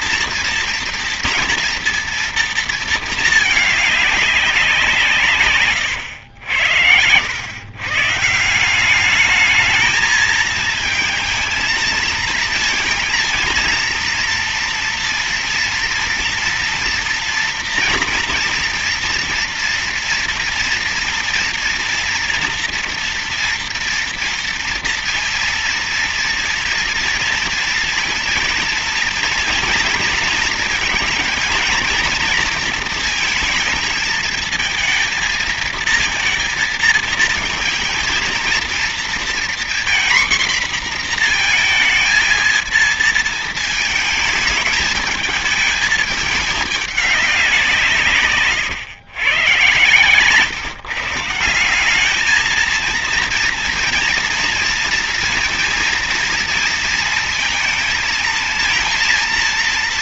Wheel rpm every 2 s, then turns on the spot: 230, 230, 190, 90, 170, 220, 230, 230, 230, 240, 230, 240, 230, 230, 230, 230, 230, 220, 230, 230, 240, 220, 220, 210, 120, 130, 220, 230, 230, 230.
none